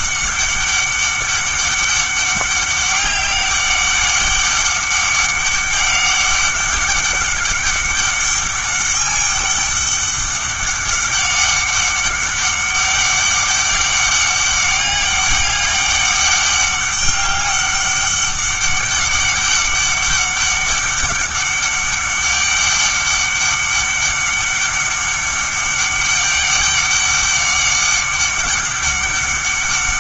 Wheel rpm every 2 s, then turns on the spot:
200, 200, 190, 200, 200, 200, 200, 200, 200, 200, 200, 200, 200, 200, 200.
none